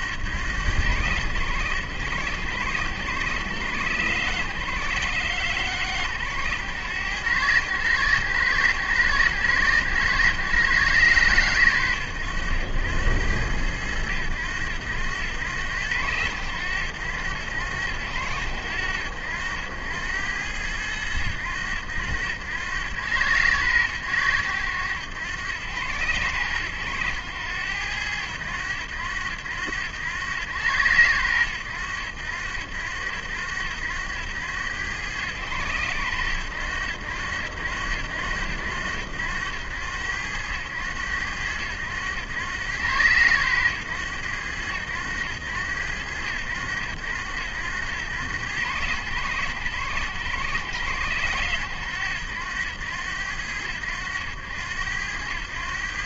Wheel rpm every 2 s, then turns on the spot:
100, 80, 100, 90, 80, 90, 80, 90, 90, 80, 90, 90, 90, 80, 80, 90, 70, 90, 90, 80, 100, 100, 100, 90, 90, 70, 90, 90.
none